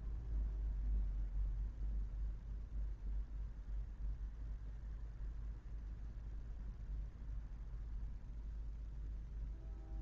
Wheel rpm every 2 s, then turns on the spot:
0, 0, 0, 0, 0.
none